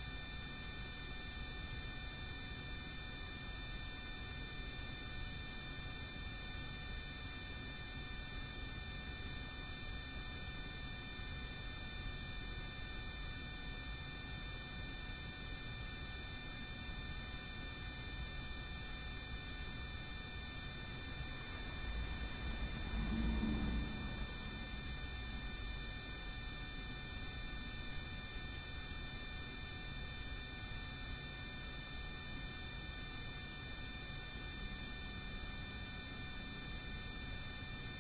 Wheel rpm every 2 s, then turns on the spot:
0, 0, 0, 0, 0, 0, 0, 0, 0, 0, 0, 0, 0, 0, 0, 0, 0, 0, 0.
none